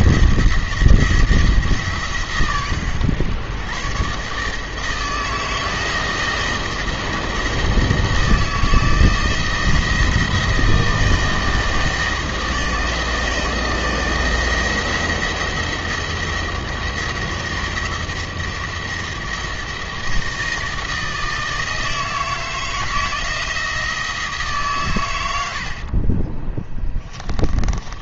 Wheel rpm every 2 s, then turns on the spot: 170, 120, 150, 160, 160, 160, 160, 170, 170, 170, 160, 160, 140, 10.
26-28